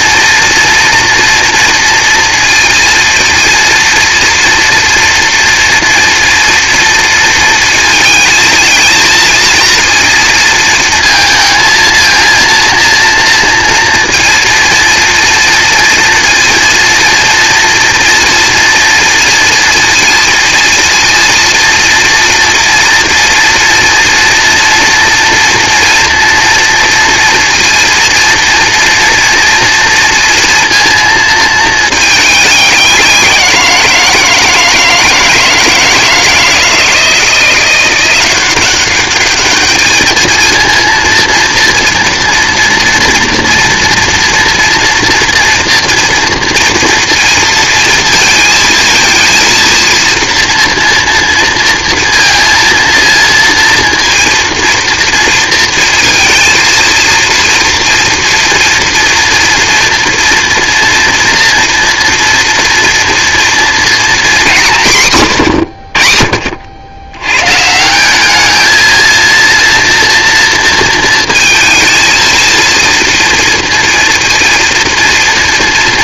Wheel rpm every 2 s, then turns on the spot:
230, 230, 230, 230, 220, 230, 230, 230, 230, 230, 230, 240, 240, 240, 240, 230, 200, 170, 170, 190, 230, 240, 230, 230, 230, 230, 230, 230, 230, 240, 230, 230, 220, 60, 220, 230, 230, 230.
none